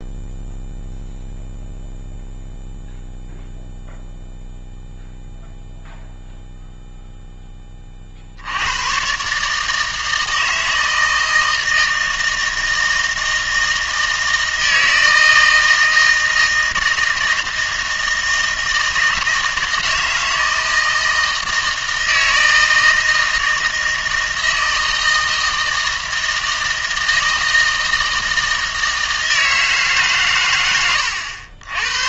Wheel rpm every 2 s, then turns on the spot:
0, 0, 0, 0, 100, 160, 160, 160, 160, 160, 160, 160, 160, 160, 160, 110.
30-32